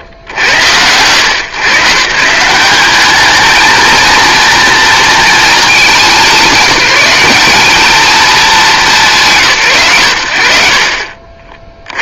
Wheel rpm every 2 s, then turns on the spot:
70, 170, 230, 180, 230, 60.
none